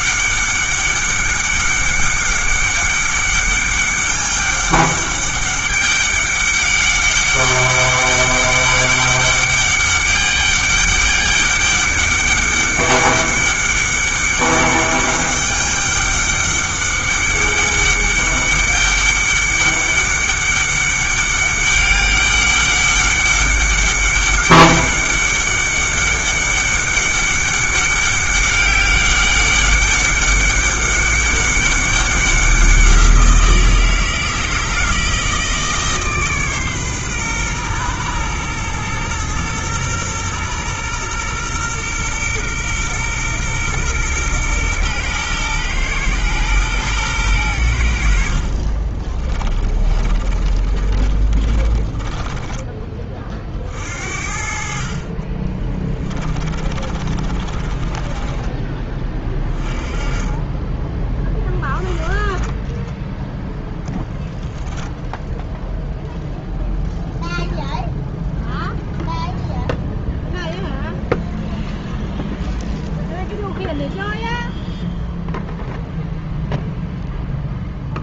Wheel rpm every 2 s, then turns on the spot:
200, 200, 200, 200, 200, 200, 200, 200, 200, 200, 200, 200, 200, 200, 190, 200, 180, 160, 130, 120, 120, 120, 120, 120, 40, 30, 20, 50, 30, 20, 20, 10, 10, 0, 0, 0, 0, 0, 0.
48-52 56-58